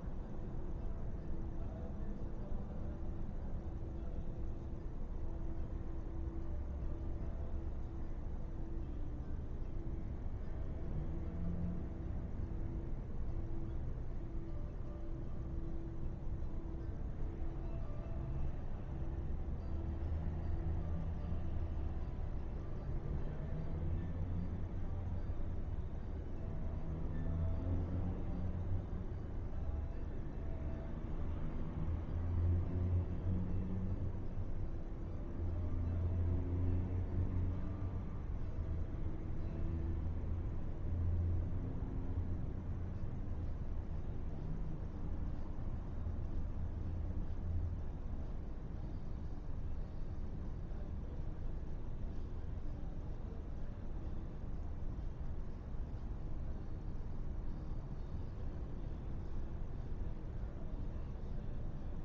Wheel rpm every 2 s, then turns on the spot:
0, 0, 0, 0, 0, 0, 0, 0, 0, 0, 0, 0, 0, 0, 0, 0, 0, 0, 0, 0, 0, 0, 0, 0, 0, 0, 0, 0, 0, 0, 0.
none